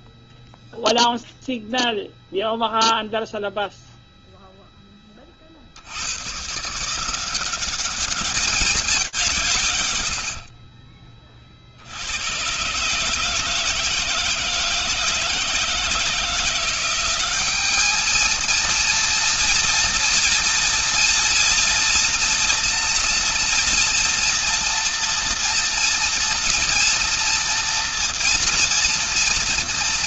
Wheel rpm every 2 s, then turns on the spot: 0, 0, 0, 150, 190, 50, 140, 160, 180, 230, 230, 230, 230, 240, 230.
none